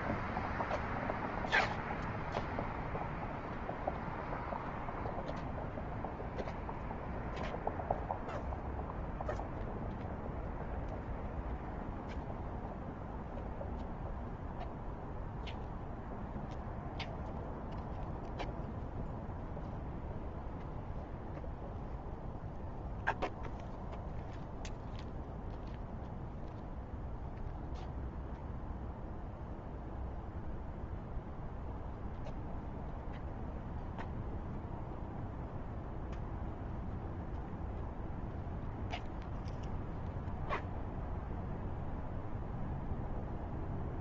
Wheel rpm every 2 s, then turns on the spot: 0, 0, 0, 0, 0, 0, 0, 0, 0, 0, 0, 0, 0, 0, 0, 0, 0, 0, 0, 0, 0, 0.
none